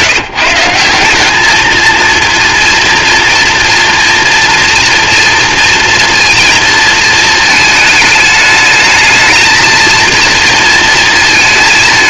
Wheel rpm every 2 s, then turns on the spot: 160, 230, 230, 230, 220, 230.
none